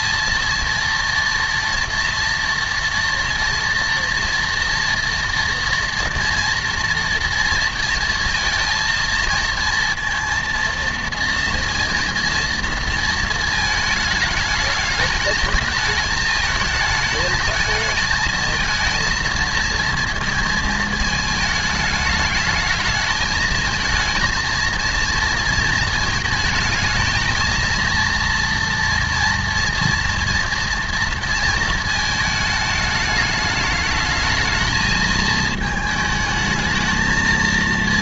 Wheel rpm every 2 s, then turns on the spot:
230, 230, 230, 230, 230, 230, 230, 210, 220, 230, 230, 220, 230, 220, 230, 230, 210, 220, 220.
none